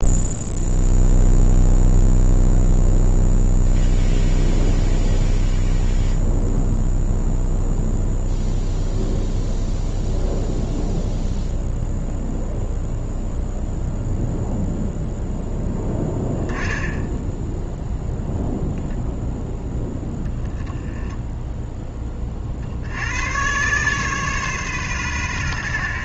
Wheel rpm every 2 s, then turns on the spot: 0, 0, 0, 0, 0, 0, 0, 0, 10, 0, 10, 60, 130.
none